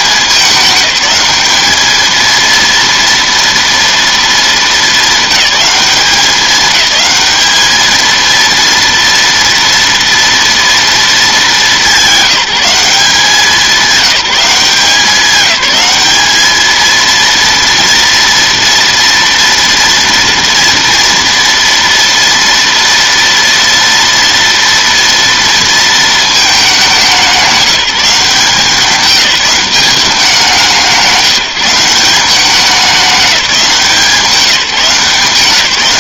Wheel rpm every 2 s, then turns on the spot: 200, 230, 210, 200, 230, 230, 190, 190, 220, 230, 230, 230, 230, 210, 180, 180, 190, 180.
none